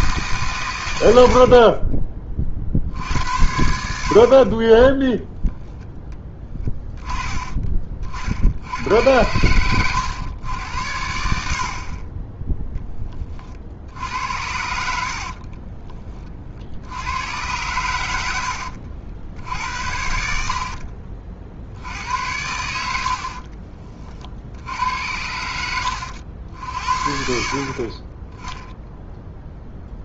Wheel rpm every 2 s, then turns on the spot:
120, 40, 30, 10, 80, 90, 10, 70, 30, 80, 60, 90, 70, 60, 10.
18-22